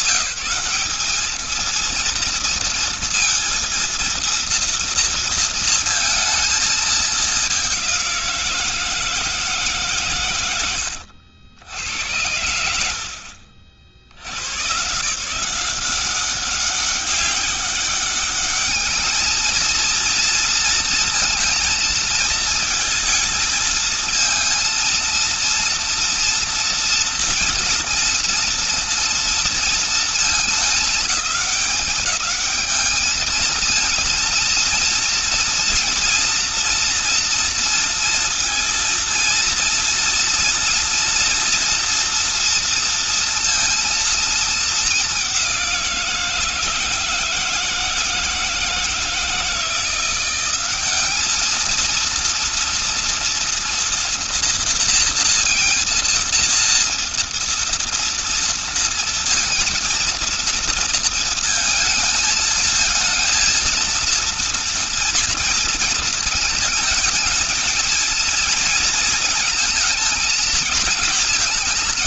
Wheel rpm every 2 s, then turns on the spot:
190, 230, 230, 220, 170, 90, 80, 120, 190, 210, 230, 230, 230, 230, 230, 210, 210, 230, 240, 230, 230, 230, 220, 170, 160, 180, 230, 230, 230, 230, 230, 220, 230, 220, 230, 230.
none